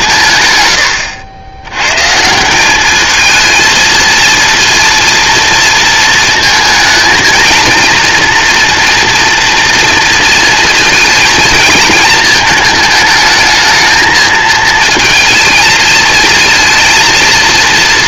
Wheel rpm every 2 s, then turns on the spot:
120, 190, 230, 220, 230, 230, 220, 220, 230.
none